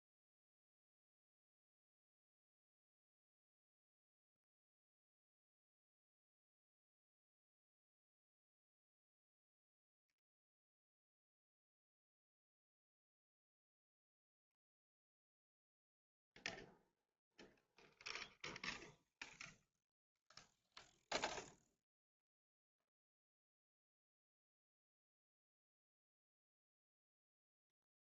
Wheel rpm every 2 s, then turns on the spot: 0, 0, 0, 0, 0, 0, 0, 0, 0, 0, 0, 0, 0, 0.
none